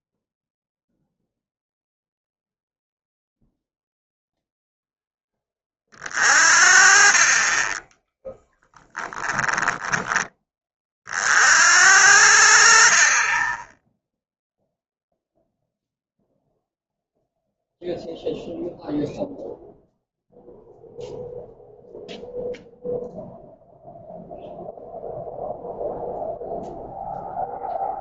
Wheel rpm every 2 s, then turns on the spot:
0, 0, 10, 40, 10, 30, 40, 0, 0, 0, 0, 0, 0, 0.
8-10